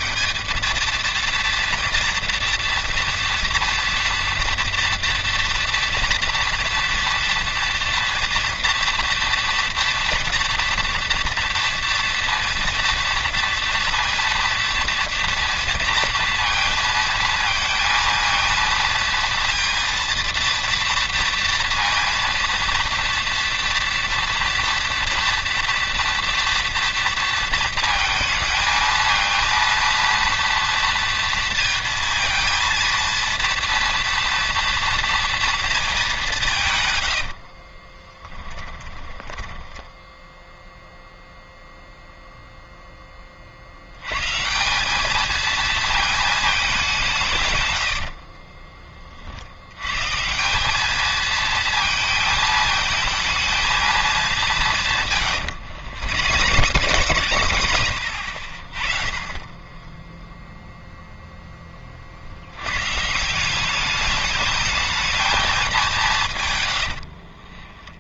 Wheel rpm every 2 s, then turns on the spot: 220, 240, 230, 240, 230, 230, 230, 230, 230, 230, 230, 230, 230, 230, 230, 230, 230, 230, 130, 20, 0, 0, 180, 210, 30, 200, 220, 170, 110, 40, 0, 110, 210, 100.
38-40 48-50 56-58 66-68